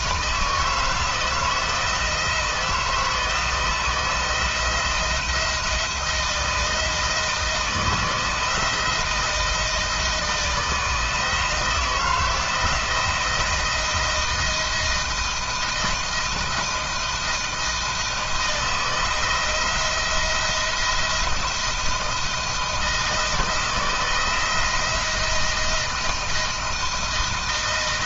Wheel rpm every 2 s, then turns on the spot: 160, 160, 170, 170, 170, 160, 170, 170, 160, 160, 170, 160, 170, 160.
none